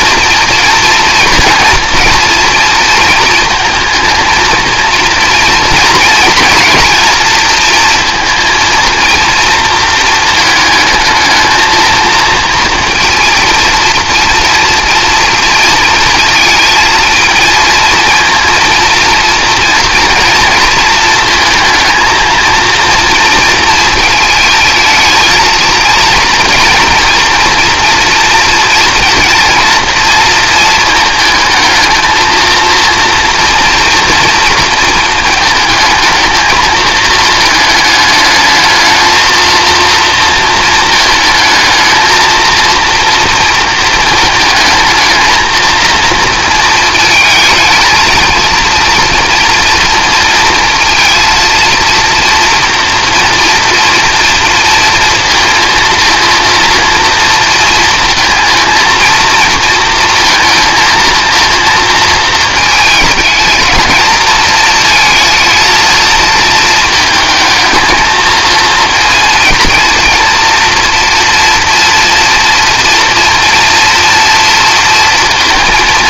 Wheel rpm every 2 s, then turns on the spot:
230, 230, 220, 220, 230, 220, 230, 230, 230, 230, 230, 230, 220, 230, 230, 230, 230, 230, 220, 210, 220, 230, 220, 230, 230, 230, 230, 230, 230, 230, 230, 220, 220, 220, 230, 230, 240, 230.
none